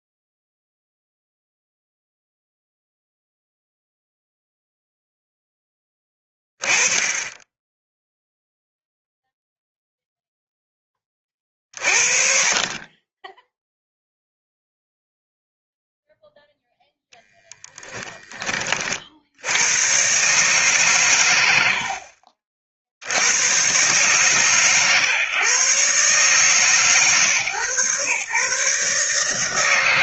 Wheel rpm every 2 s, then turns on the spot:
0, 0, 0, 20, 0, 20, 30, 0, 0, 40, 140, 60, 130, 140, 140.
none